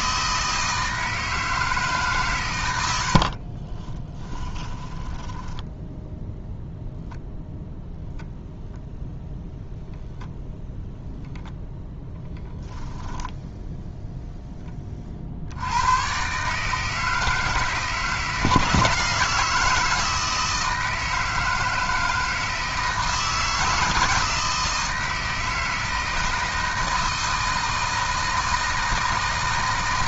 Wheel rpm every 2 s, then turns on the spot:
160, 80, 10, 0, 0, 0, 0, 20, 160, 160, 160, 160, 160, 160, 160.
4-6